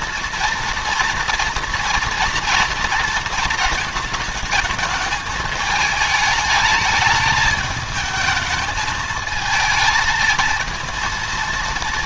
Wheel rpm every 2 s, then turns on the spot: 230, 230, 210, 210, 220, 230.
none